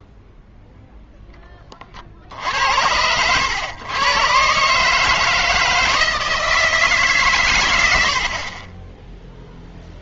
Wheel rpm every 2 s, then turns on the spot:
0, 80, 140, 160, 40.
none